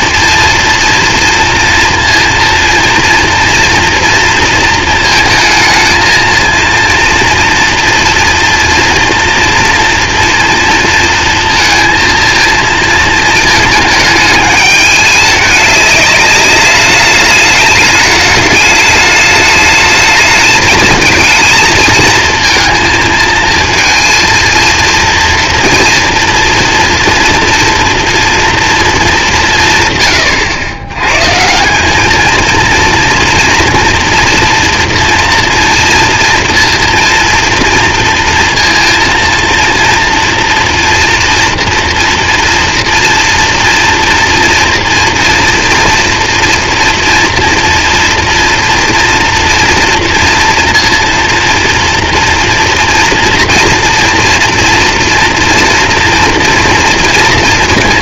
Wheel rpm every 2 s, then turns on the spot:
230, 230, 230, 230, 230, 230, 230, 210, 210, 210, 220, 230, 230, 230, 220, 100, 230, 230, 230, 230, 240, 230, 230, 230, 230, 230, 230, 230, 230.
none